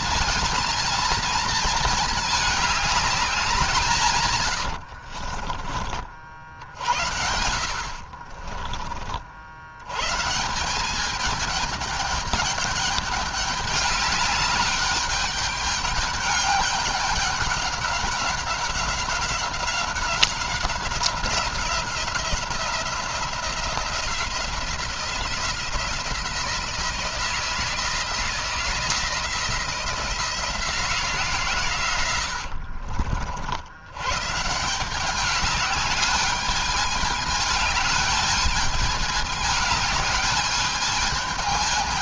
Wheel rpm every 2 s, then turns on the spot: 230, 200, 60, 70, 50, 190, 210, 200, 200, 190, 190, 180, 170, 170, 170, 170, 60, 180, 210, 210, 210.
4-6 32-34